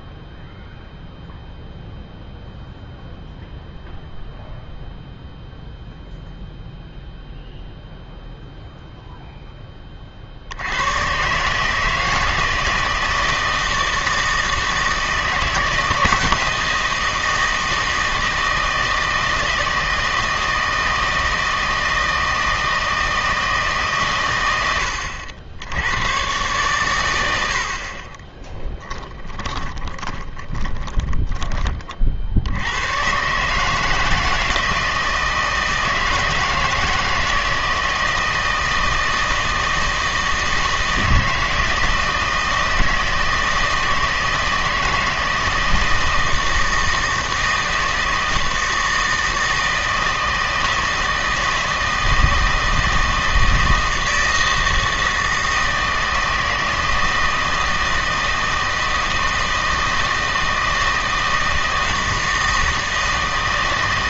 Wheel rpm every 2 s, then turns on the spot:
0, 0, 0, 0, 0, 90, 160, 160, 170, 160, 160, 160, 90, 110, 20, 10, 100, 160, 160, 160, 160, 160, 160, 160, 160, 160, 160, 160, 160, 160, 160, 160.
28-32